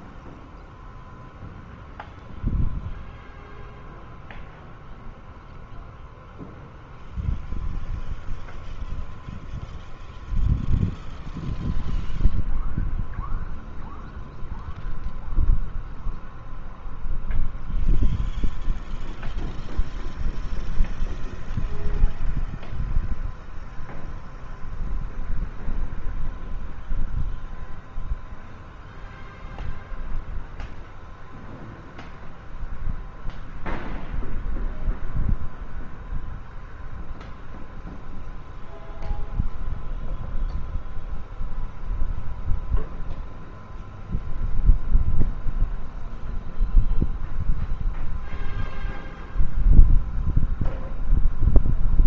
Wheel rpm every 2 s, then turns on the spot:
0, 0, 0, 0, 0, 0, 0, 0, 0, 0, 0, 0, 0, 0, 0, 0, 0, 0, 0, 0, 0, 0, 0, 0, 0, 0.
none